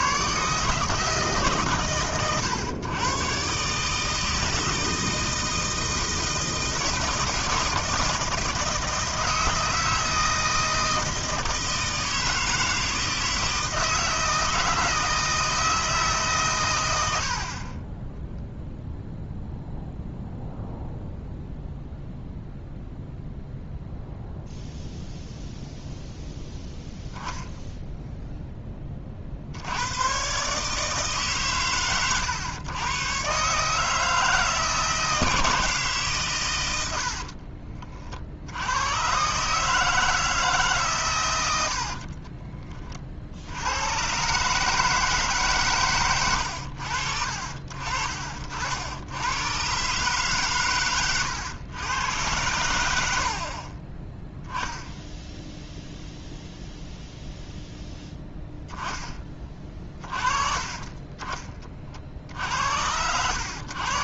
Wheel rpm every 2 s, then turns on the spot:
150, 110, 160, 160, 160, 160, 160, 160, 110, 0, 0, 0, 0, 0, 10, 140, 110, 160, 110, 90, 160, 30, 150, 80, 60, 110, 90, 10, 0, 10, 40, 70.
none